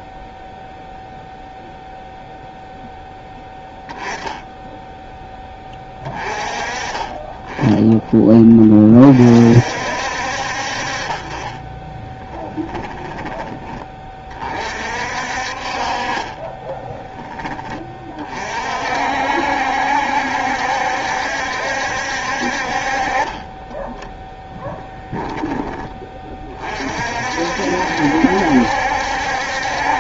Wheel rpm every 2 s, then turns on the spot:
0, 0, 10, 30, 30, 50, 20, 40, 20, 50, 70, 40, 10, 40, 70.
12-14 16-18 24-26